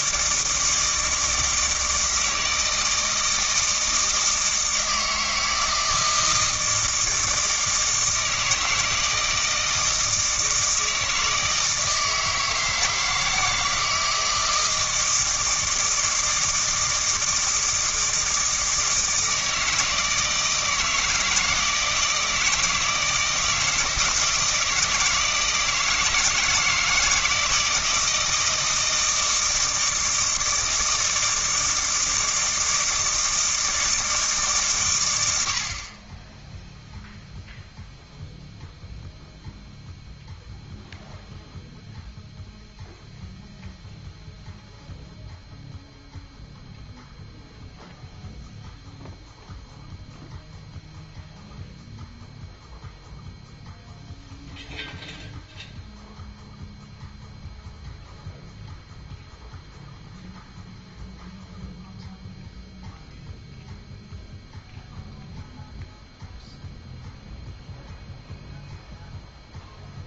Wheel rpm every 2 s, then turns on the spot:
160, 160, 160, 160, 160, 160, 160, 160, 160, 160, 160, 160, 160, 160, 160, 160, 160, 120, 0, 0, 0, 0, 0, 0, 0, 0, 0, 0, 0, 0, 0, 0, 0, 0, 0.
none